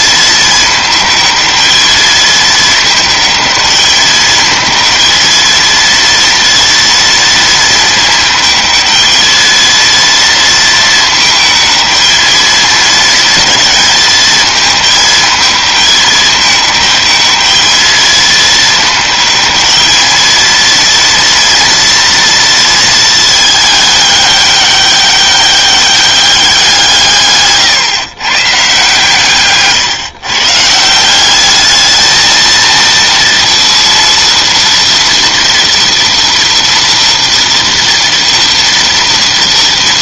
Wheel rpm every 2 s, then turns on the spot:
220, 220, 220, 230, 220, 230, 220, 220, 210, 220, 230, 230, 200, 170, 140, 160, 230, 230, 230, 230.
none